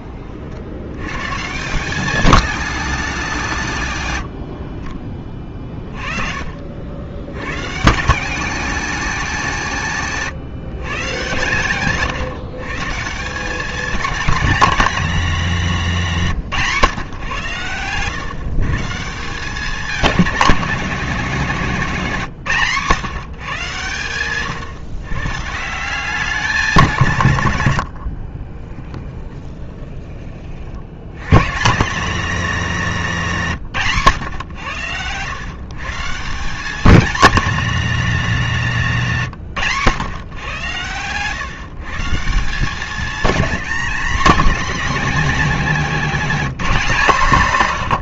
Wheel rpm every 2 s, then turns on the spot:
90, 200, 40, 80, 220, 140, 150, 220, 150, 150, 200, 140, 130, 180, 20, 70, 200, 100, 200, 170, 120, 180, 190, 200.
28-30